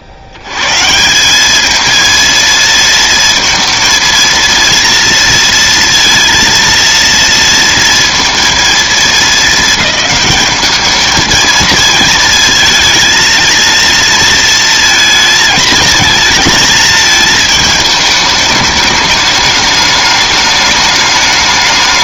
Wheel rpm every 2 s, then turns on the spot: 80, 230, 230, 230, 230, 210, 230, 230, 220, 210, 210.
none